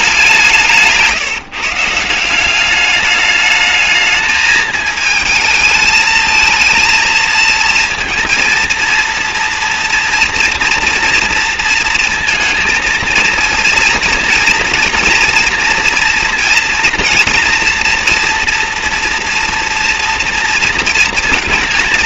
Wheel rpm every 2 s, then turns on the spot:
170, 200, 220, 220, 230, 230, 230, 230, 230, 240, 230.
none